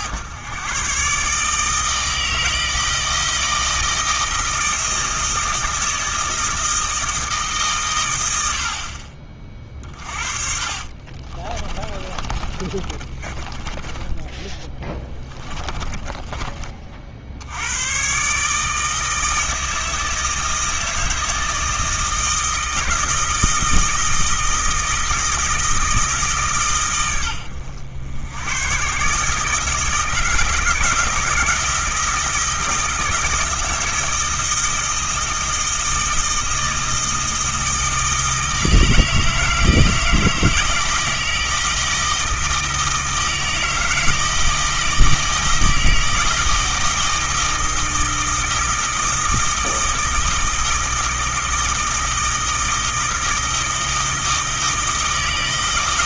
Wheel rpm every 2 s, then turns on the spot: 130, 160, 160, 160, 50, 40, 30, 20, 40, 160, 160, 160, 160, 120, 120, 160, 160, 160, 160, 160, 160, 160, 160, 160, 160, 160, 160, 160.
10-16